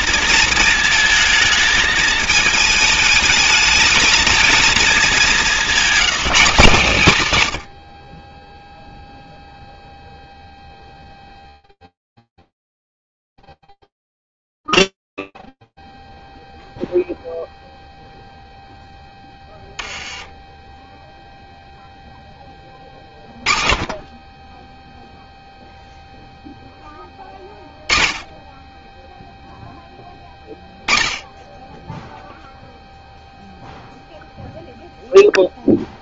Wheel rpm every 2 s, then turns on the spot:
230, 210, 220, 180, 0, 0, 0, 0, 0, 10, 10, 30, 0, 10, 0, 20, 0, 0.
22-24